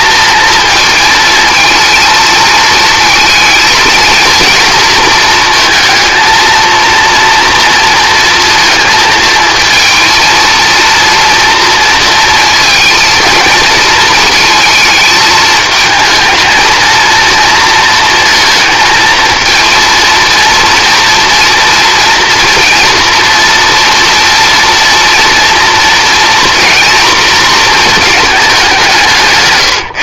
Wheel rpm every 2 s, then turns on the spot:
220, 220, 220, 230, 230, 230, 230, 220, 230, 220, 230, 230, 230, 230, 180.
none